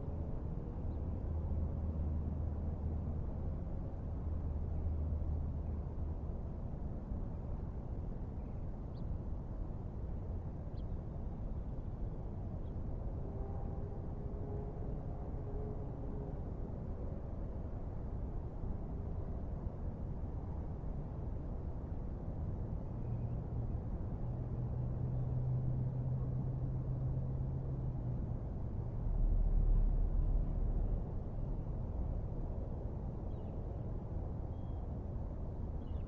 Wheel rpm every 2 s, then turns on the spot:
0, 0, 0, 0, 0, 0, 0, 0, 0, 0, 0, 0, 0, 0, 0, 0, 0, 0.
none